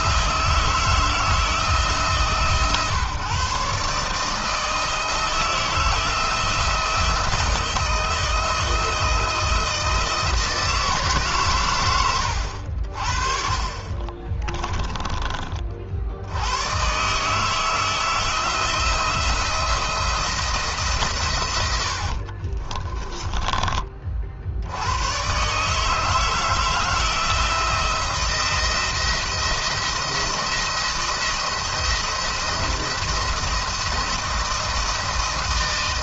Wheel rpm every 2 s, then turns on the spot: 160, 140, 160, 160, 160, 170, 70, 20, 120, 170, 160, 30, 100, 160, 170, 170, 170, 170.
22-24